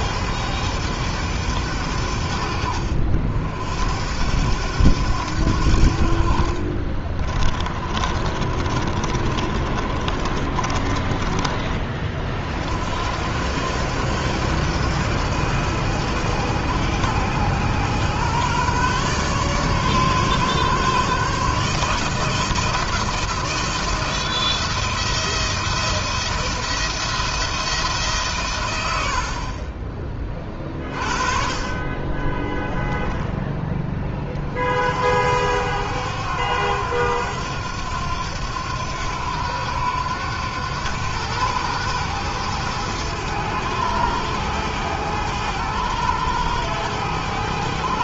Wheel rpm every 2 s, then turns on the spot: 100, 70, 90, 30, 30, 20, 70, 100, 110, 130, 140, 170, 170, 170, 80, 20, 20, 60, 90, 90, 100, 110, 100, 100.
6-12 32-34